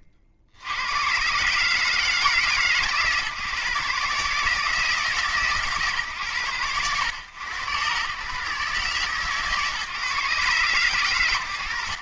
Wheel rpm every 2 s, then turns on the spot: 90, 140, 150, 100, 140, 120.
none